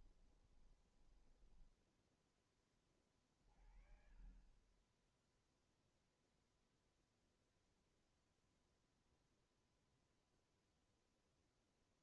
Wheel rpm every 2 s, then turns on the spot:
20, 10, 40, 0, 0, 0.
0-2